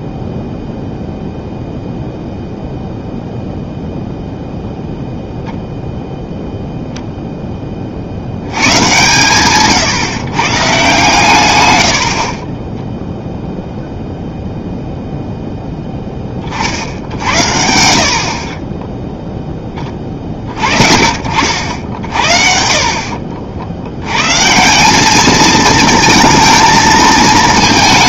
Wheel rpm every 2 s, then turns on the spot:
0, 0, 0, 0, 110, 140, 20, 0, 50, 30, 30, 50, 160, 220.
none